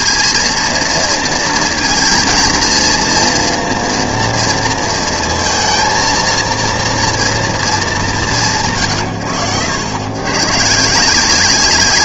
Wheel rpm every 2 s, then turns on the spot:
230, 230, 230, 230, 100, 140.
none